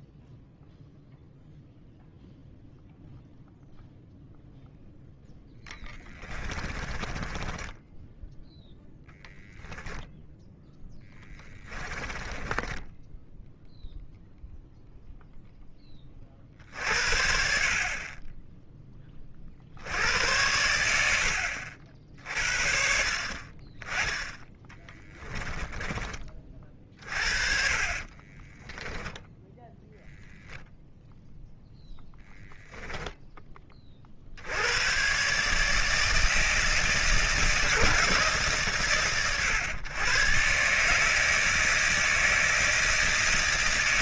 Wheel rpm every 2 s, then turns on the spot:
0, 0, 0, 20, 0, 10, 10, 0, 60, 40, 70, 50, 10, 40, 10, 0, 10, 120, 160, 120, 150, 160.
6-8 10-12 20-22 24-26